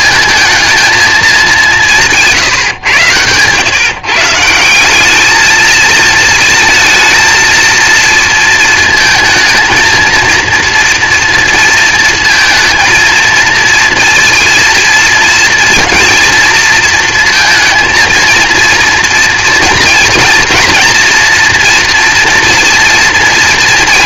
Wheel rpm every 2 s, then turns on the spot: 220, 140, 170, 230, 230, 230, 220, 230, 230, 230, 230, 230.
none